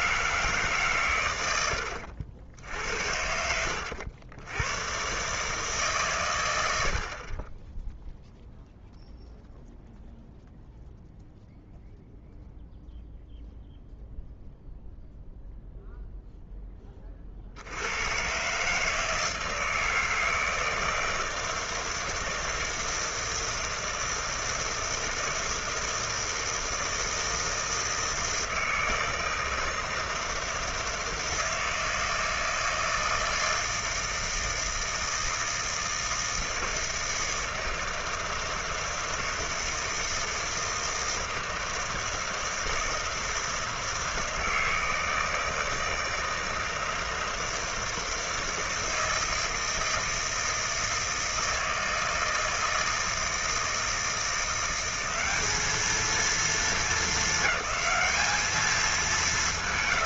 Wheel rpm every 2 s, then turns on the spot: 150, 70, 100, 80, 0, 0, 0, 0, 10, 140, 160, 160, 160, 160, 160, 160, 160, 160, 160, 160, 160, 160, 160, 160, 160, 160, 160, 180, 220, 210.
none